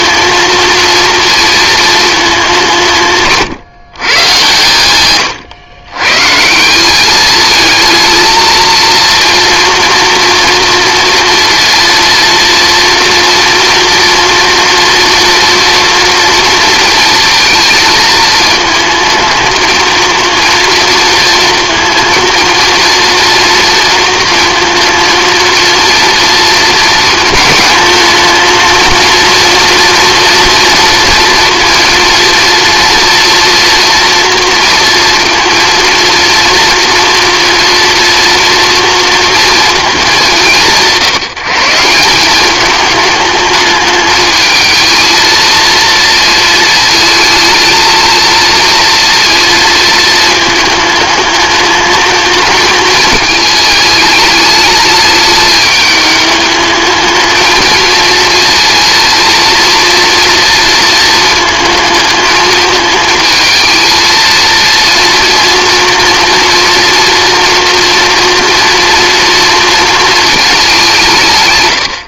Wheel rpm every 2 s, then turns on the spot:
230, 170, 110, 200, 230, 230, 230, 230, 230, 220, 230, 230, 230, 230, 230, 230, 230, 230, 230, 230, 160, 210, 220, 220, 230, 220, 220, 210, 220, 230, 220, 220, 230, 230, 230, 190.
none